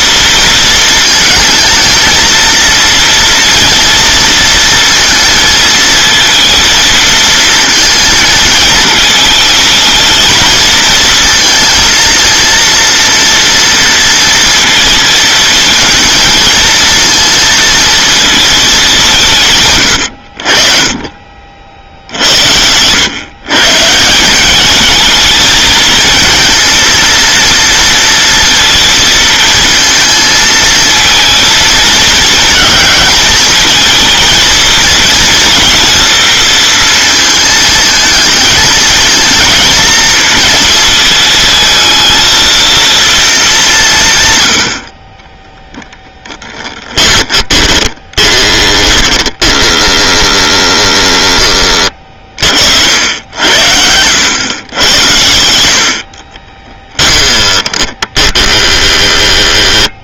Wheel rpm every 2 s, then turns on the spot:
230, 230, 230, 230, 220, 220, 230, 230, 220, 200, 40, 100, 220, 230, 230, 220, 220, 230, 230, 230, 220, 230, 60, 20, 10, 10, 70, 100, 10, 10.
46-50 56-58